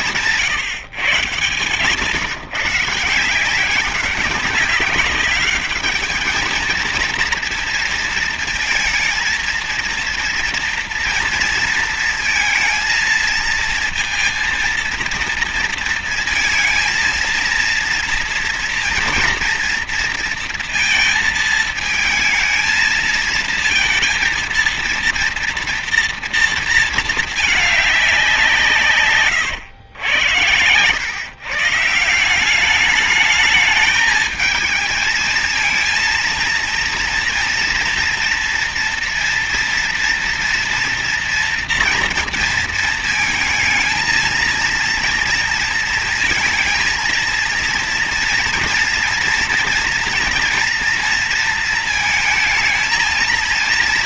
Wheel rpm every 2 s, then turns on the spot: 160, 160, 190, 220, 230, 230, 230, 230, 230, 230, 230, 220, 230, 230, 180, 110, 190, 220, 230, 230, 230, 230, 230, 230, 230, 230, 220.
none